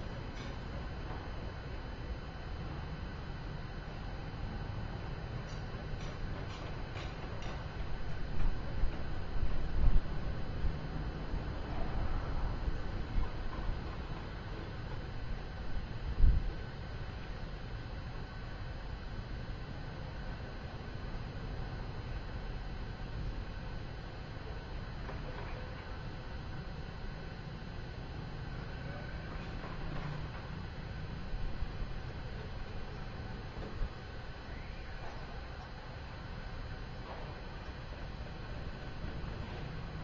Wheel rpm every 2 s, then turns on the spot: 0, 0, 0, 0, 0, 0, 0, 0, 0, 0, 0, 0, 0, 0, 0, 0, 0, 0, 0, 0.
none